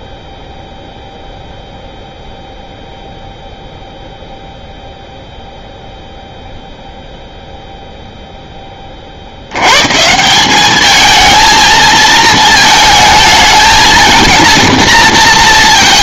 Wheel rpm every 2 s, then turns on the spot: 0, 0, 0, 0, 30, 210, 220, 230.
none